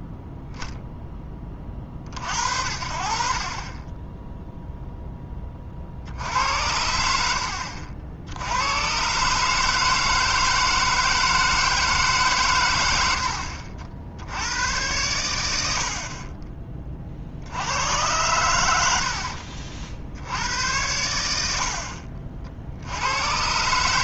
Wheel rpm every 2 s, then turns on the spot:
0, 60, 0, 80, 120, 160, 110, 100, 30, 80, 90, 80.
none